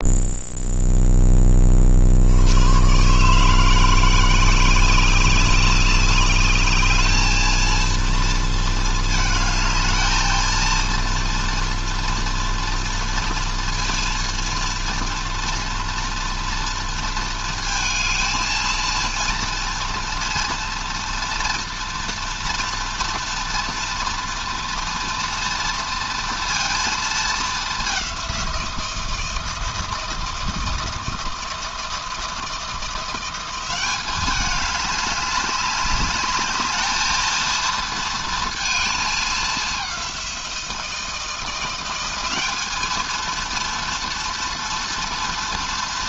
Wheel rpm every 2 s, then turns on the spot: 10, 130, 190, 220, 220, 230, 230, 240, 230, 230, 240, 230, 230, 220, 160, 160, 170, 200, 230, 220, 170, 230, 230.
none